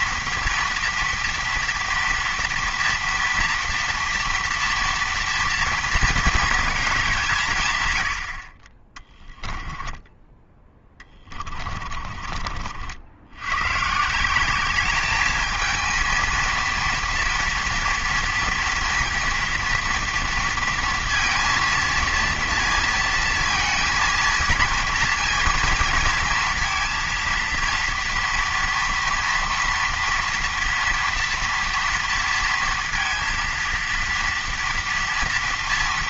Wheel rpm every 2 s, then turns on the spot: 230, 230, 230, 220, 40, 10, 50, 190, 230, 230, 230, 230, 230, 230, 230, 230, 230, 230.
none